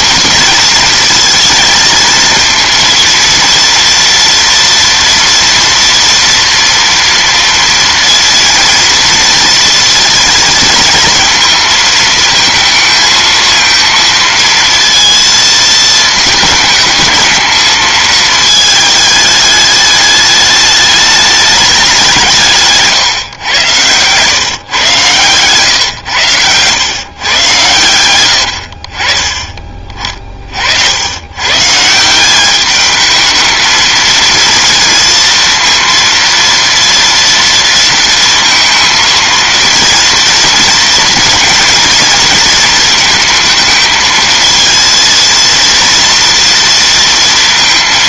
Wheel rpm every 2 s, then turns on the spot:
230, 230, 230, 230, 230, 230, 220, 230, 220, 220, 210, 190, 110, 120, 100, 40, 180, 230, 230, 230, 230, 230, 220, 230.
none